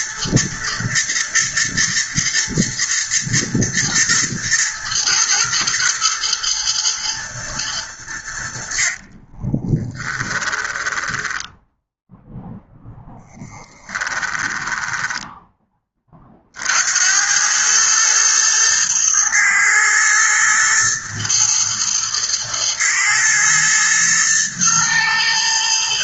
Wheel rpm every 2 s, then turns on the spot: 110, 110, 110, 120, 50, 10, 0, 10, 80, 110, 110, 110, 120.
8-12 14-16